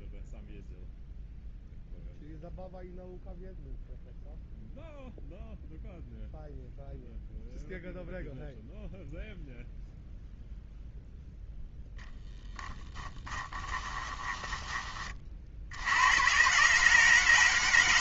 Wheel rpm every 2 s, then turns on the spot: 0, 0, 0, 0, 0, 0, 10, 20, 130.
12-16